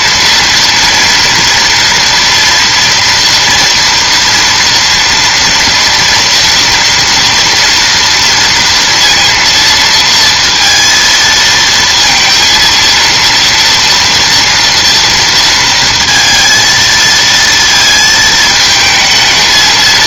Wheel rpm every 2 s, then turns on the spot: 230, 230, 230, 230, 230, 230, 230, 240, 230, 220.
none